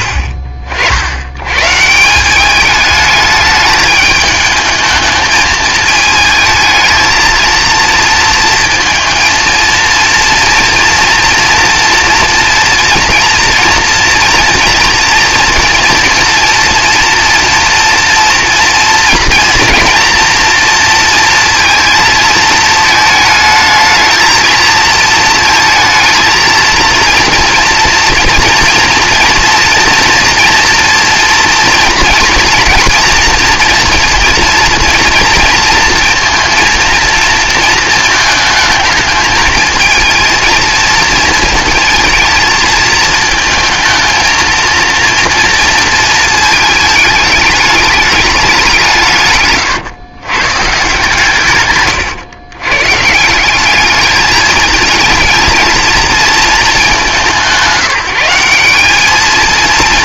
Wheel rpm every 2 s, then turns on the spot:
80, 200, 220, 220, 230, 230, 230, 230, 230, 230, 230, 220, 230, 230, 240, 230, 240, 230, 230, 220, 230, 220, 230, 220, 180, 140, 130, 220, 210, 190.
none